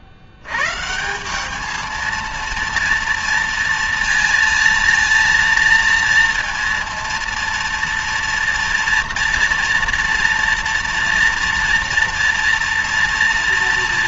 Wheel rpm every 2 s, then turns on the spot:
110, 230, 230, 230, 230, 230, 230.
none